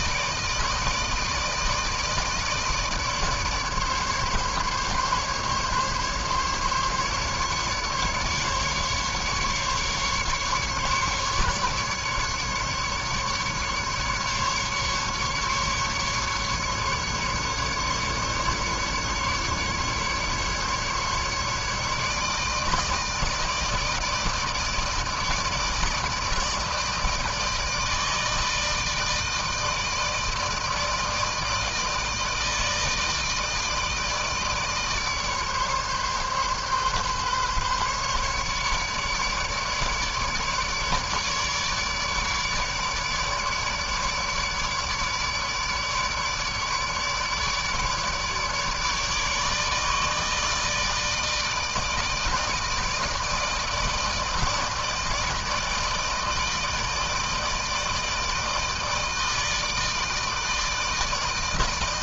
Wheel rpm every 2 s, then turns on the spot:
160, 150, 140, 150, 150, 150, 140, 150, 140, 140, 150, 160, 160, 160, 160, 160, 160, 150, 140, 150, 150, 150, 150, 150, 150, 160, 160, 160, 160, 160, 160.
none